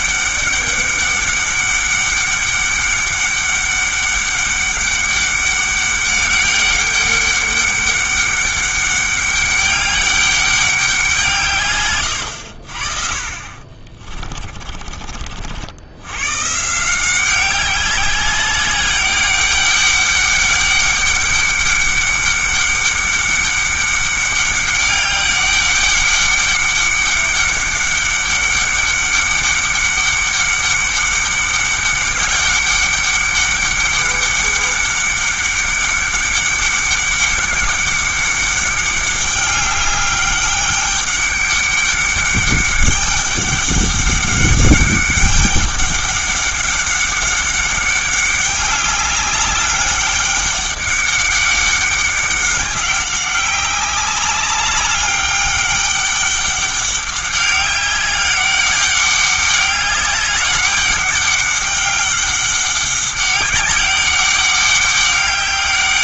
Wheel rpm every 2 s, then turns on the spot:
200, 200, 200, 200, 200, 190, 50, 40, 170, 200, 200, 200, 200, 200, 200, 200, 200, 200, 200, 200, 200, 200, 200, 200, 200, 200, 190, 200, 200, 200, 200, 190, 200.
14-16